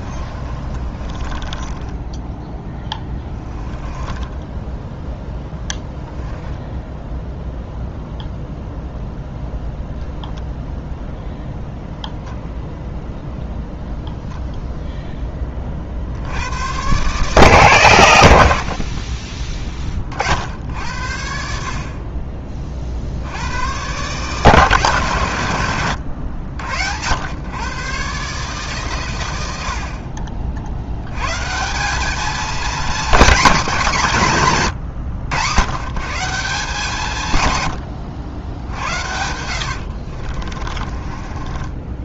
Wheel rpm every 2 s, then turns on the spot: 30, 10, 10, 10, 0, 0, 0, 0, 110, 60, 70, 40, 130, 80, 140, 70, 230, 150, 160, 80, 40.
0-2 38-42